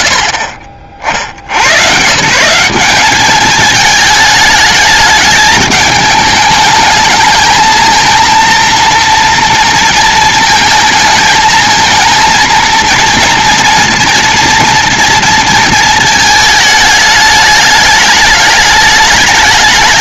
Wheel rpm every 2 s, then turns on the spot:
50, 190, 210, 210, 230, 230, 230, 230, 220, 210.
none